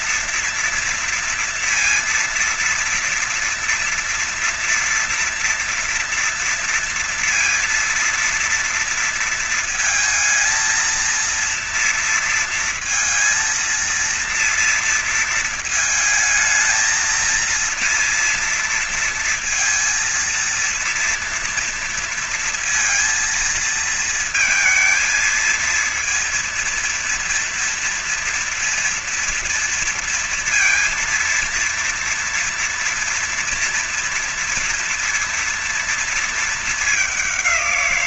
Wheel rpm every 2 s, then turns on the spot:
230, 230, 240, 230, 230, 230, 230, 230, 220, 230, 230, 230, 220, 230, 230, 230, 230, 230, 230.
none